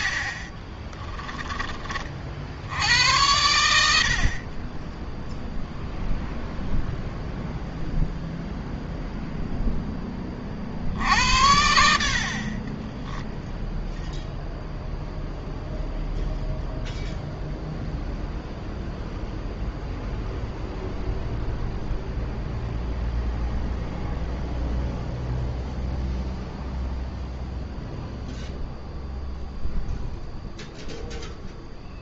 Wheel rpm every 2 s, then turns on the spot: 20, 70, 10, 0, 0, 60, 40, 0, 0, 0, 0, 0, 0, 0, 0, 0.
0-2 12-14